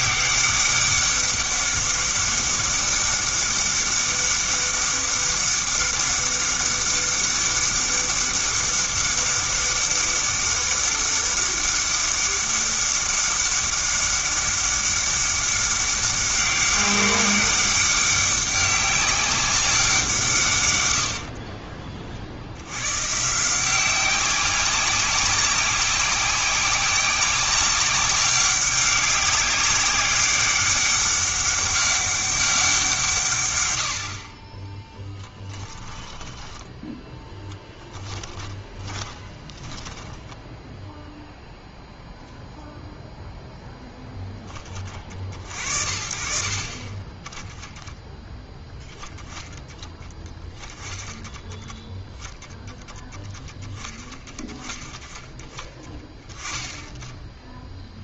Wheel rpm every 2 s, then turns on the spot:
200, 200, 200, 200, 200, 200, 200, 200, 200, 200, 90, 110, 190, 190, 200, 200, 170, 10, 10, 20, 0, 0, 30, 20, 10, 20, 10, 10, 10.
34-40